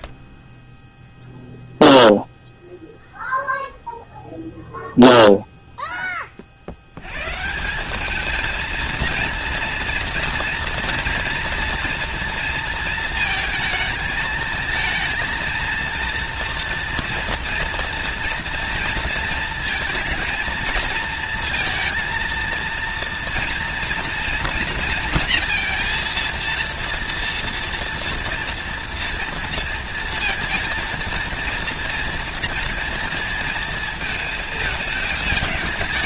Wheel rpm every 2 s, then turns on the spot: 20, 0, 0, 40, 220, 230, 230, 220, 230, 230, 230, 230, 230, 230, 230, 230, 230, 220.
none